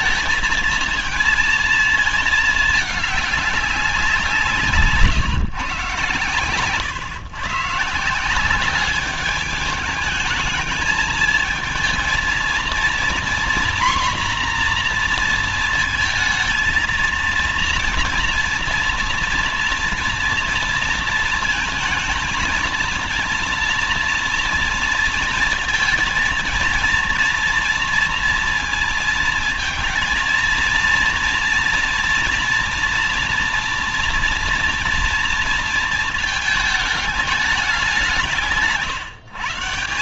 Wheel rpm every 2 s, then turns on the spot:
220, 220, 150, 120, 190, 210, 230, 240, 230, 230, 230, 230, 230, 230, 230, 230, 230, 230, 210, 150.
4-6